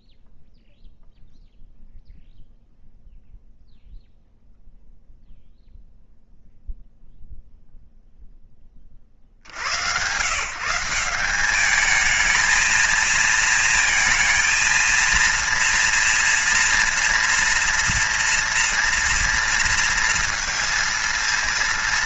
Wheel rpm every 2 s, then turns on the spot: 0, 0, 0, 0, 30, 170, 220, 230, 240, 230, 230.
none